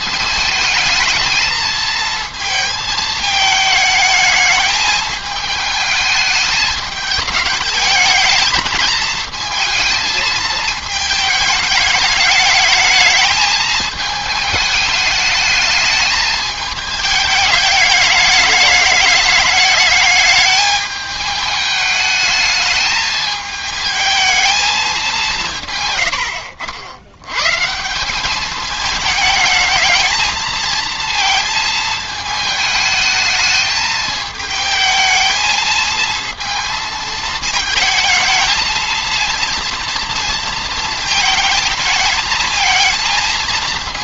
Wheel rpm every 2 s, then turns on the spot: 220, 220, 220, 210, 220, 220, 210, 210, 220, 210, 210, 210, 220, 80, 210, 220, 220, 220, 230, 220, 230, 230.
none